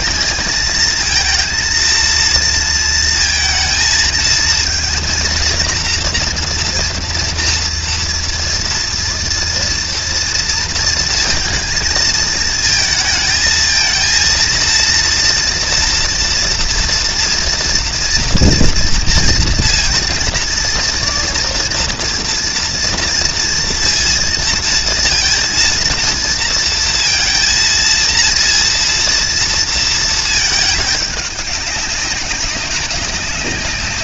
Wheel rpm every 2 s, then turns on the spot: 230, 230, 230, 230, 230, 230, 220, 230, 230, 240, 230, 230, 230, 230, 230, 210, 200.
none